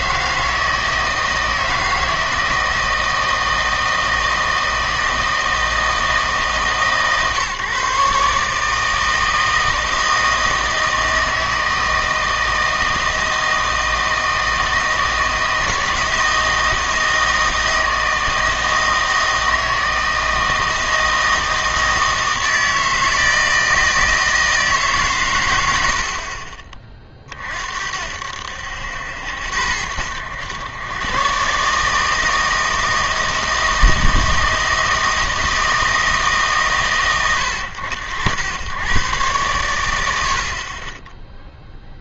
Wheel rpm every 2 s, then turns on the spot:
160, 160, 160, 160, 150, 160, 160, 160, 160, 160, 160, 160, 160, 40, 80, 100, 160, 160, 140, 100, 50.
none